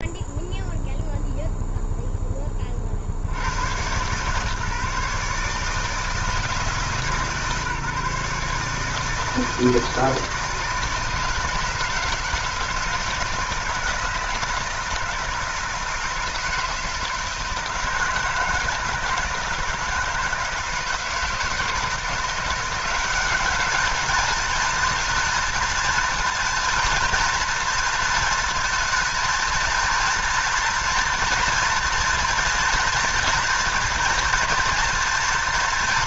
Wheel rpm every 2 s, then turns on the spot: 0, 30, 140, 150, 150, 160, 160, 160, 160, 160, 160, 170, 220, 230, 220, 230, 230, 240.
none